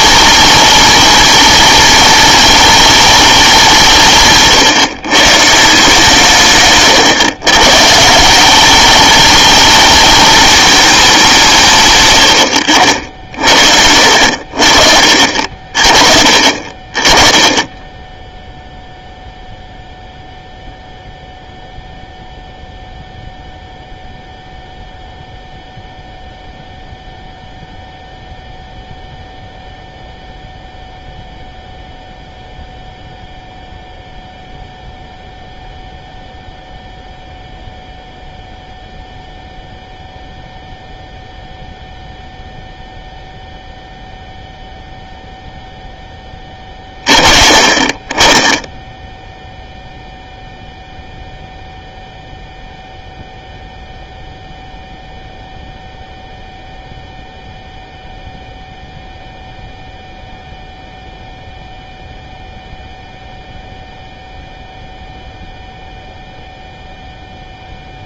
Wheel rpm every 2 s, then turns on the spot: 210, 210, 140, 130, 190, 220, 80, 60, 40, 0, 0, 0, 0, 0, 0, 0, 0, 0, 0, 0, 0, 0, 0, 20, 10, 0, 0, 0, 0, 0, 0, 0, 0, 0.
6-8